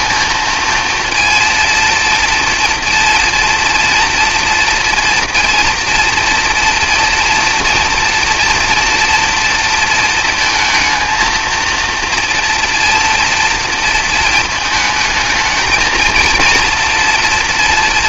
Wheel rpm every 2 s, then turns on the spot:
230, 240, 230, 230, 230, 230, 240, 220, 230.
none